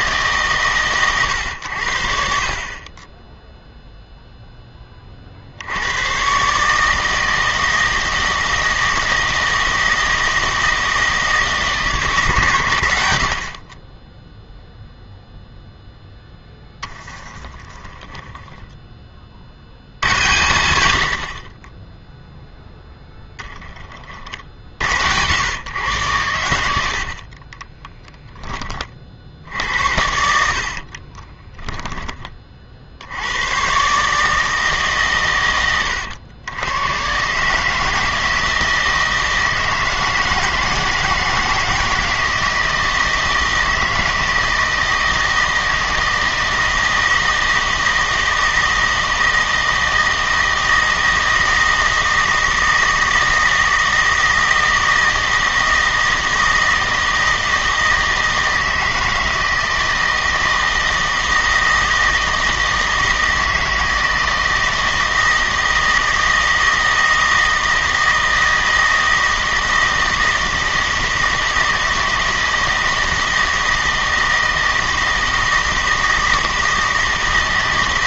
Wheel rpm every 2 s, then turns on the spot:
130, 30, 10, 140, 160, 160, 100, 0, 10, 10, 90, 10, 60, 70, 20, 50, 60, 150, 110, 160, 160, 160, 160, 160, 160, 160, 160, 160, 160, 160, 160, 160, 160, 160, 160, 160, 160, 160, 160.
16-20 22-24 30-32